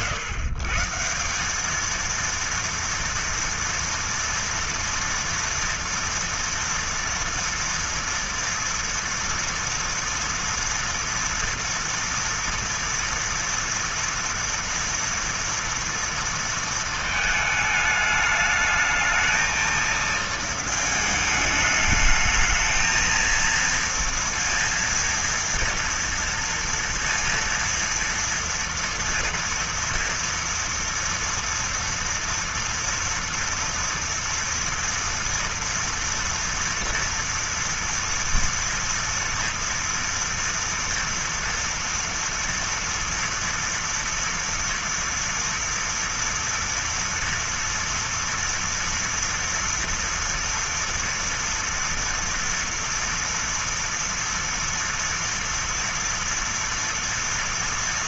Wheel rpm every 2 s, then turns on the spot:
150, 230, 230, 230, 230, 230, 230, 230, 220, 210, 220, 220, 230, 230, 230, 230, 230, 240, 230, 230, 230, 230, 230, 230, 230, 230, 230, 230, 230.
none